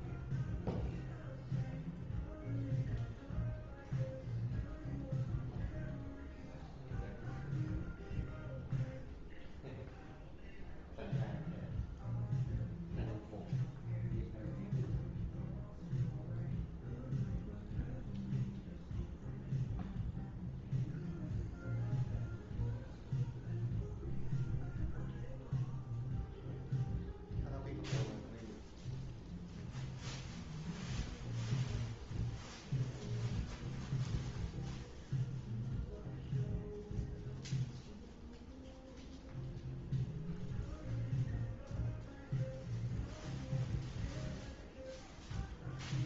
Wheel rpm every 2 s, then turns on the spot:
0, 0, 0, 0, 0, 0, 0, 0, 0, 0, 0, 0, 0, 0, 0, 0, 0, 0, 0, 0, 0, 0, 0.
none